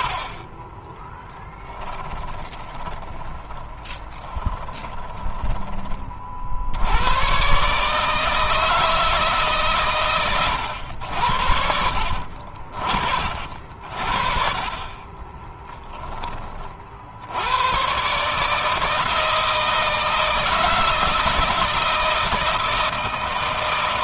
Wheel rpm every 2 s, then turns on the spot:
10, 20, 20, 60, 160, 110, 50, 40, 30, 150, 160, 160.
0-6